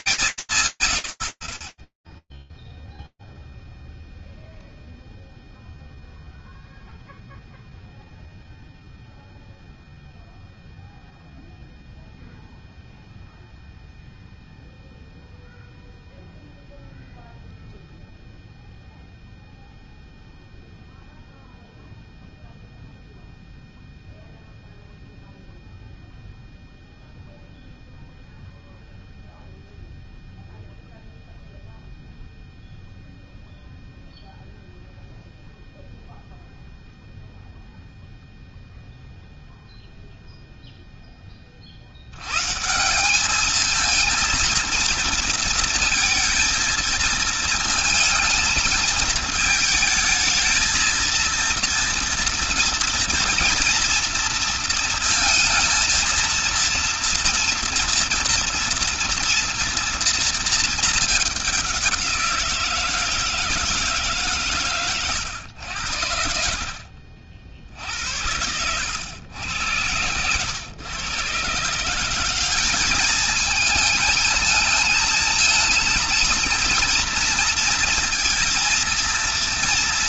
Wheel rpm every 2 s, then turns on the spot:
140, 0, 0, 0, 0, 0, 0, 0, 0, 0, 0, 0, 0, 0, 0, 0, 0, 0, 0, 0, 60, 220, 230, 220, 220, 230, 230, 230, 230, 230, 200, 160, 90, 70, 90, 140, 220, 230, 230, 230.
none